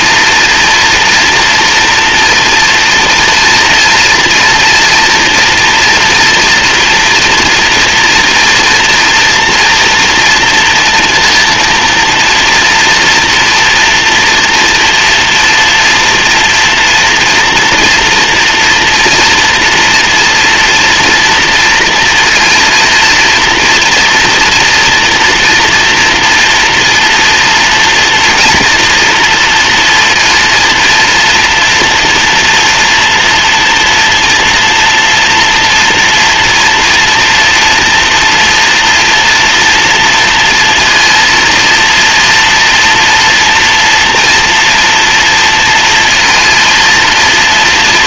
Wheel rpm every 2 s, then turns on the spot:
230, 230, 240, 230, 230, 230, 240, 230, 230, 230, 230, 230, 230, 230, 230, 230, 240, 230, 230, 230, 230, 230, 230, 230.
none